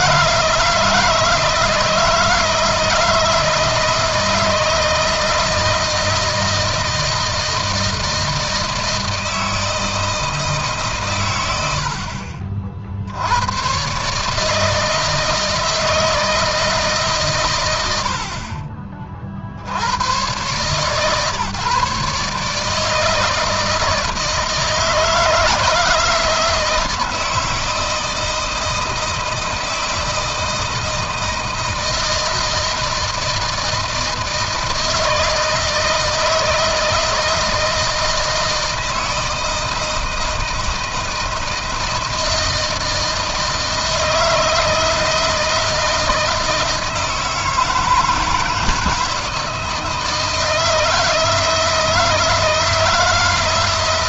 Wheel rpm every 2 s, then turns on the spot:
160, 160, 160, 160, 160, 120, 70, 160, 140, 50, 140, 160, 160, 160, 160, 160, 160, 160, 160, 160, 160, 160, 160, 160, 160, 160, 160.
none